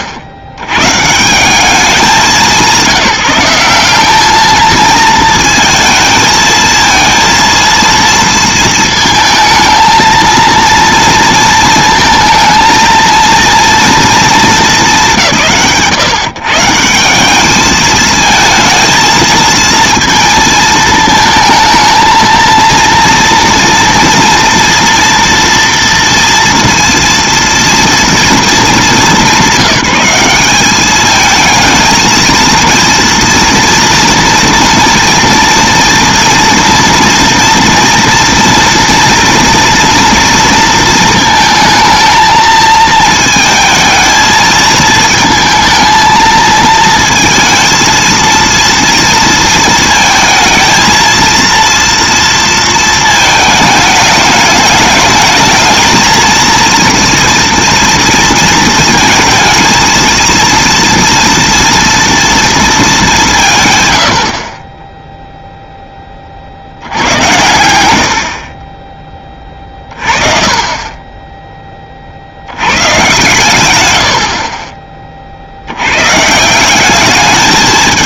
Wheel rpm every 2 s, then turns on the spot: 80, 170, 230, 230, 230, 230, 230, 150, 150, 220, 220, 230, 230, 230, 200, 200, 230, 230, 230, 230, 230, 230, 220, 230, 230, 220, 230, 210, 230, 230, 230, 220, 20, 50, 30, 30, 80, 40, 150.
none